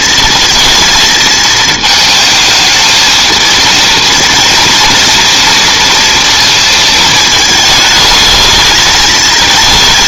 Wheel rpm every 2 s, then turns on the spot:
230, 220, 230, 220, 220.
none